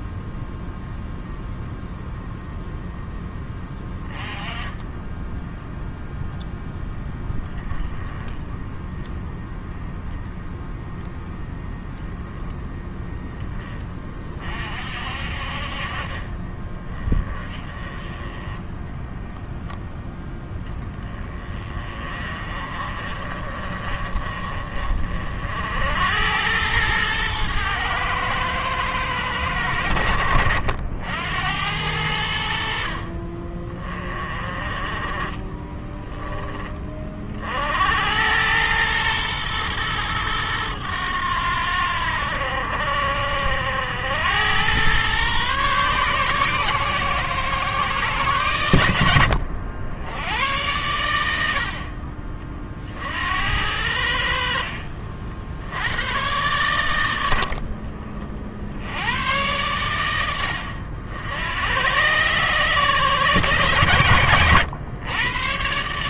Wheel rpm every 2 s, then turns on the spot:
0, 0, 10, 0, 0, 0, 0, 50, 20, 10, 10, 30, 40, 110, 110, 70, 60, 30, 20, 110, 100, 60, 110, 130, 90, 90, 40, 50, 90, 80, 70, 130, 110.
none